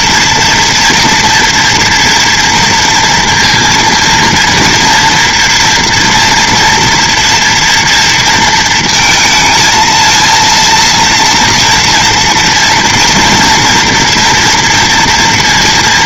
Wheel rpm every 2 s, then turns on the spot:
230, 230, 230, 230, 230, 230, 240, 230.
none